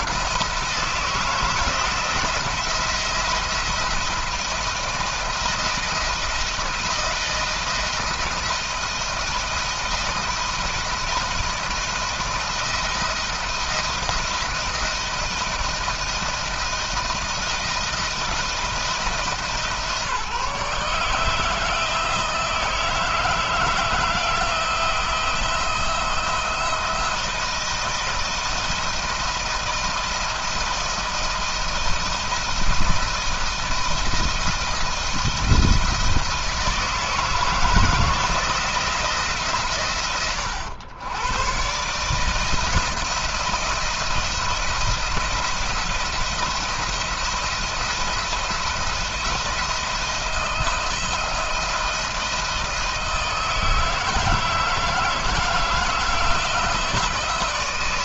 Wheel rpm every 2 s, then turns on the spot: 170, 170, 170, 170, 170, 160, 160, 170, 160, 160, 150, 160, 160, 170, 160, 170, 160, 160, 160, 160, 110, 160, 170, 170, 170, 170, 160, 160, 160.
none